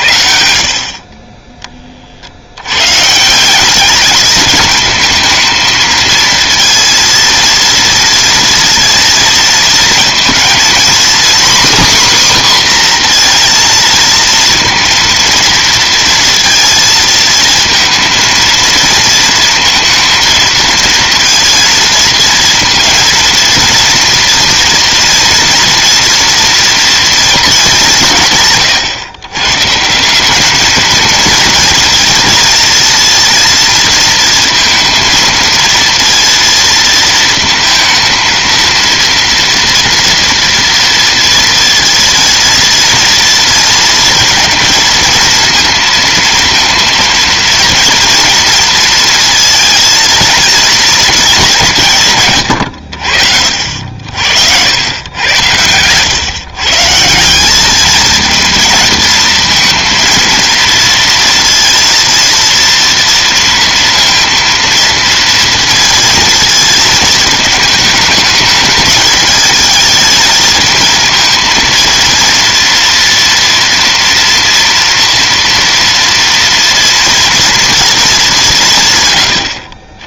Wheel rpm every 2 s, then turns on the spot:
40, 130, 220, 230, 230, 250, 250, 230, 230, 230, 230, 230, 230, 230, 110, 220, 230, 230, 230, 230, 230, 230, 230, 230, 230, 220, 60, 90, 150, 230, 230, 230, 230, 230, 210, 230, 230, 230, 240, 160.
none